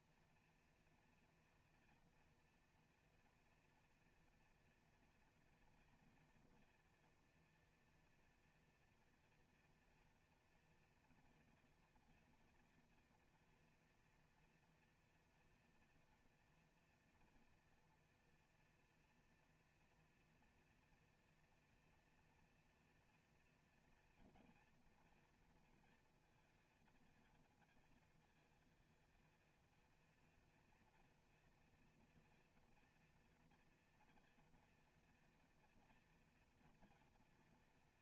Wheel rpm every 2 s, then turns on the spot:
230, 230, 230, 230, 230, 230, 230, 230, 230, 240, 230, 230, 230, 230, 230, 230, 230, 240, 240.
none